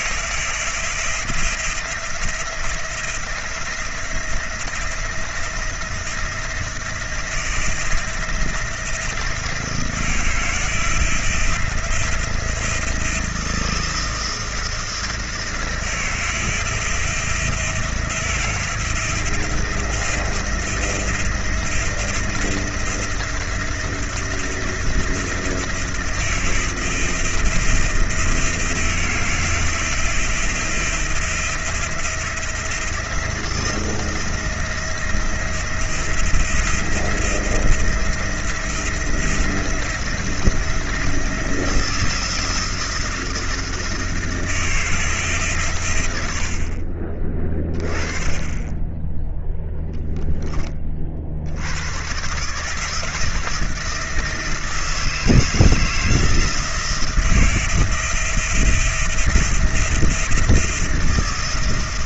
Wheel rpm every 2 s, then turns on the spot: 160, 170, 170, 170, 170, 170, 170, 170, 160, 160, 160, 160, 170, 170, 170, 170, 170, 170, 170, 170, 160, 170, 160, 90, 20, 10, 130, 170, 160, 160, 170.
none